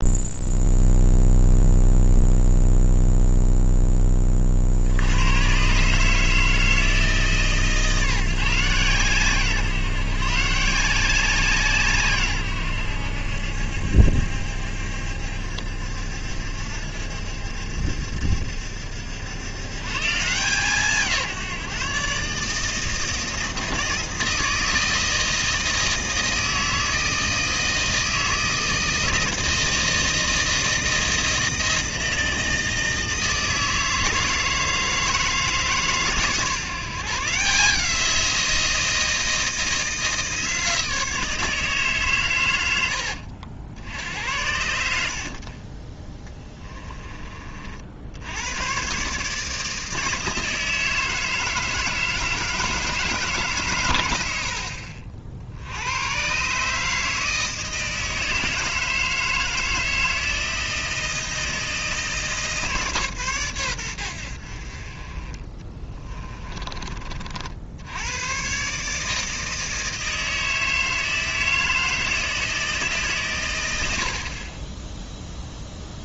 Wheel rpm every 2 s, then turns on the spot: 0, 0, 70, 160, 150, 160, 100, 70, 70, 70, 160, 160, 160, 160, 160, 160, 160, 160, 160, 170, 160, 90, 80, 20, 120, 160, 160, 60, 150, 160, 160, 150, 40, 30, 140, 160, 150, 20.
42-44